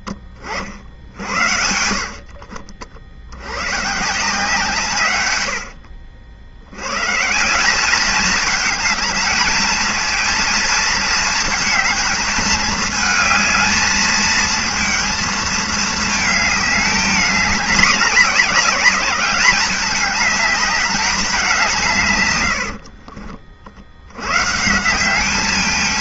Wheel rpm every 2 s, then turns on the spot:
40, 50, 150, 80, 210, 230, 220, 220, 220, 200, 210, 100, 130.
22-24